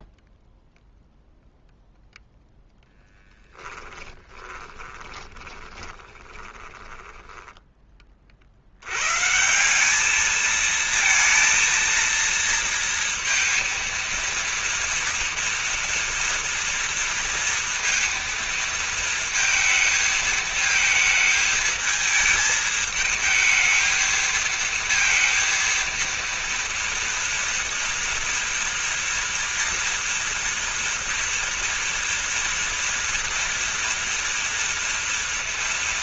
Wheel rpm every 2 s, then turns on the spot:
0, 10, 20, 20, 80, 220, 230, 230, 230, 230, 220, 220, 230, 230, 230, 230, 230, 240.
2-8